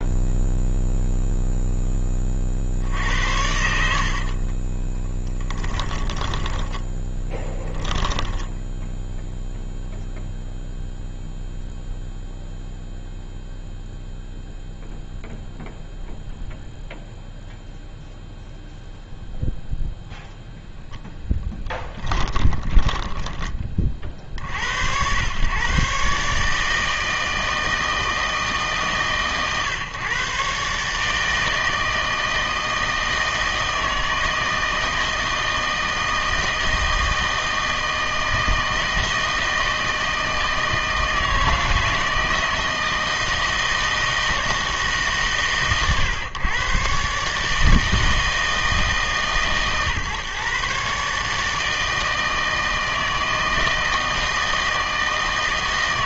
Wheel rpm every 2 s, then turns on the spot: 0, 60, 20, 10, 10, 0, 0, 0, 0, 0, 0, 10, 70, 160, 150, 150, 160, 160, 160, 160, 160, 160, 150, 130, 150, 140, 160, 160.
4-8 22-24